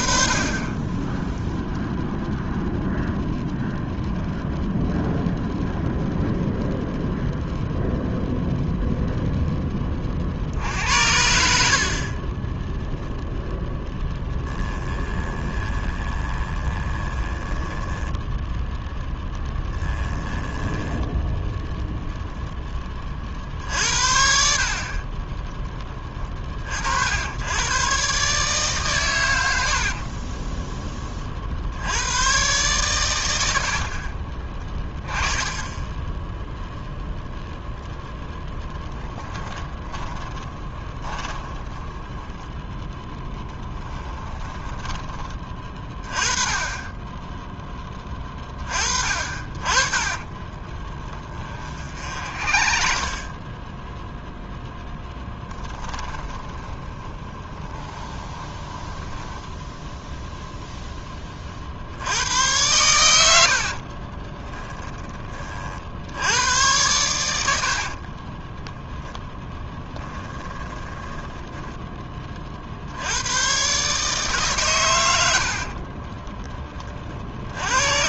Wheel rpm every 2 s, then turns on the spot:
20, 0, 0, 0, 0, 70, 10, 10, 20, 10, 10, 20, 40, 60, 130, 20, 120, 30, 0, 10, 30, 10, 20, 20, 30, 40, 40, 0, 30, 10, 10, 100, 10, 110, 10, 20, 70, 130, 30.
14-18 20-22 34-36 38-42 44-46 50-54 56-60 68-72